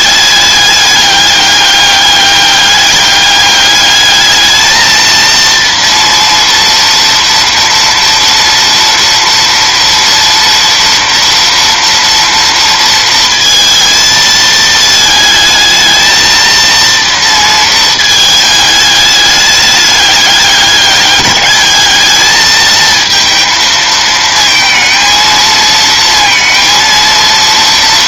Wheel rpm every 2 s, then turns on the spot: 200, 200, 220, 230, 240, 230, 230, 220, 230, 210, 200, 220, 220, 230.
none